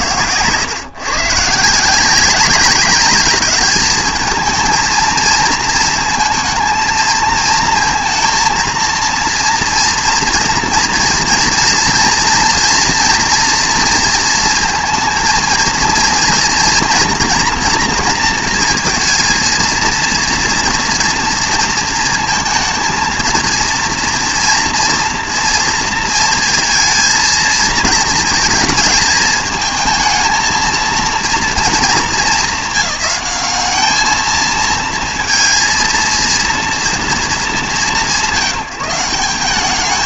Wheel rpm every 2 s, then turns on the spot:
120, 190, 230, 230, 230, 230, 240, 230, 230, 230, 230, 230, 230, 230, 220, 220, 210, 220, 230, 160.
none